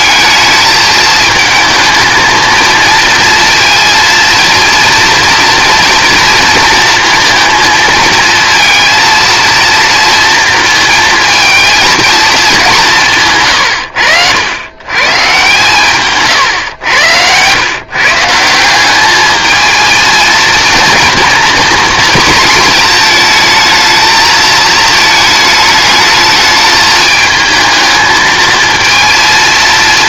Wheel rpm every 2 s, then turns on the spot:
220, 230, 230, 230, 230, 220, 170, 110, 100, 200, 230, 230, 220, 220, 230.
none